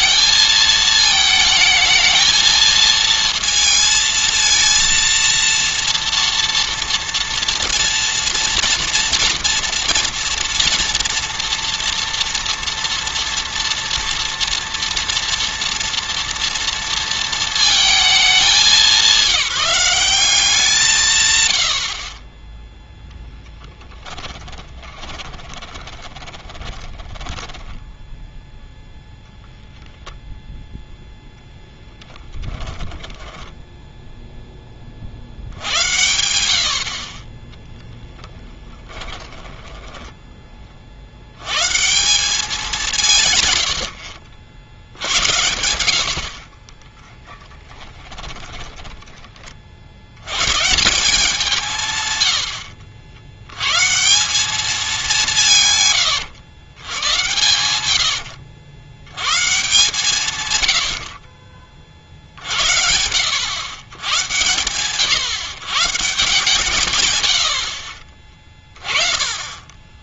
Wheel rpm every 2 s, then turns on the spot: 220, 230, 230, 230, 230, 230, 230, 240, 220, 190, 130, 10, 20, 20, 0, 0, 10, 20, 60, 10, 30, 190, 80, 20, 20, 150, 80, 210, 120, 100, 90, 80, 120, 130, 30.
22-28 32-34 38-40 48-50